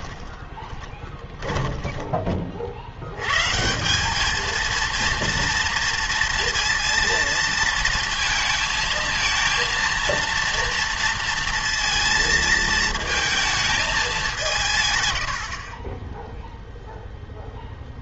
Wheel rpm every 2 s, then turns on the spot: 20, 50, 230, 230, 230, 230, 230, 150, 0.
0-2